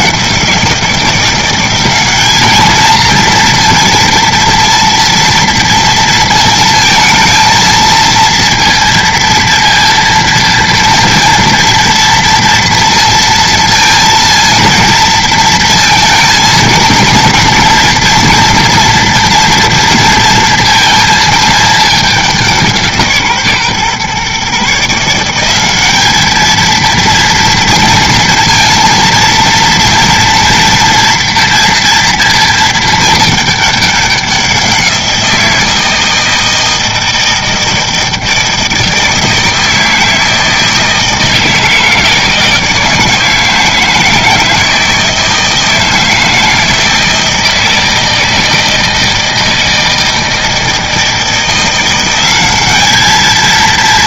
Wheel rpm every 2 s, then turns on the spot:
170, 220, 230, 230, 230, 230, 230, 230, 230, 230, 230, 170, 150, 230, 230, 230, 220, 180, 160, 160, 160, 160, 160, 160, 160, 160, 200.
none